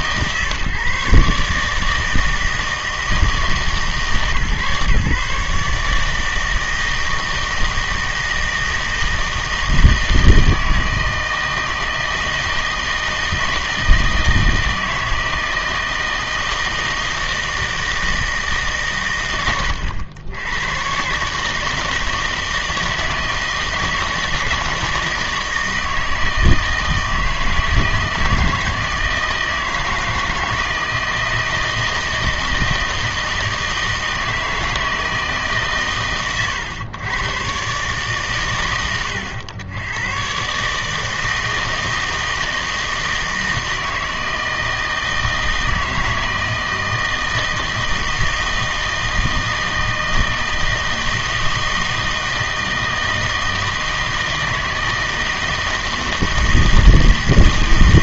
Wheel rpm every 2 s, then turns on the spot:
140, 160, 140, 160, 160, 160, 160, 160, 160, 140, 100, 160, 160, 160, 160, 160, 160, 160, 120, 110, 140, 160, 160, 160, 160, 160, 160, 160, 160.
none